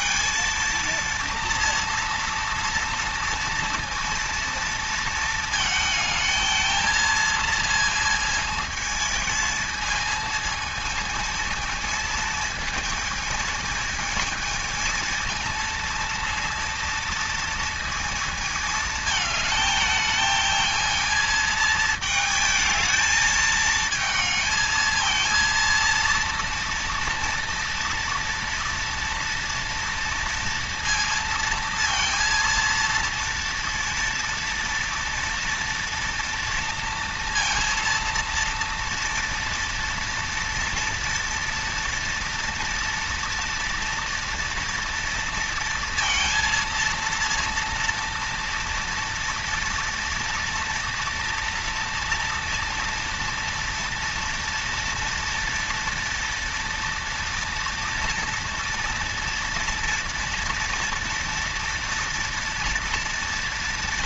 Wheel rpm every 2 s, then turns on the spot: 230, 230, 230, 220, 220, 220, 220, 220, 230, 220, 220, 220, 220, 230, 230, 230, 230, 230, 230, 230, 230, 230, 230, 230, 230, 230, 230, 240, 230, 230, 230, 240.
none